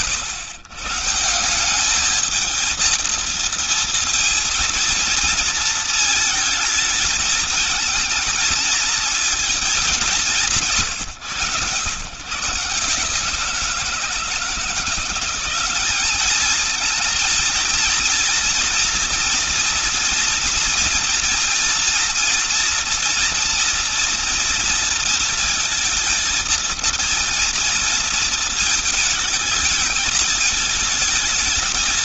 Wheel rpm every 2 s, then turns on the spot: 110, 230, 230, 220, 230, 170, 160, 170, 220, 230, 240, 230, 230, 230, 220, 220.
none